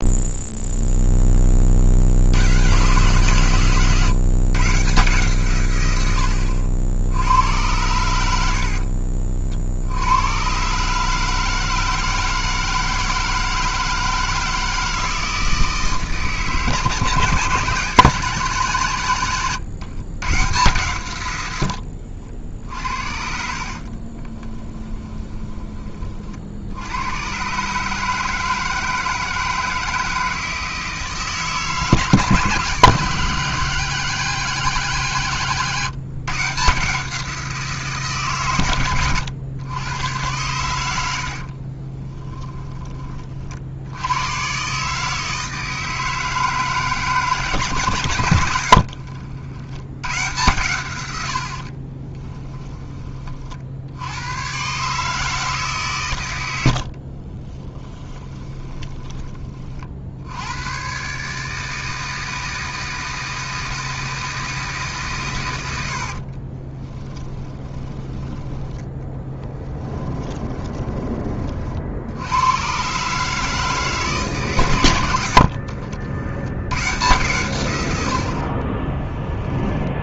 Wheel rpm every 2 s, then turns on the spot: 0, 140, 140, 80, 50, 140, 160, 160, 150, 140, 120, 60, 20, 80, 160, 160, 160, 160, 160, 110, 90, 20, 140, 150, 60, 110, 20, 140, 70, 20, 120, 160, 150, 20, 10, 20, 120, 110, 120, 30.
8-10 22-26 48-50 56-60 66-70 78-80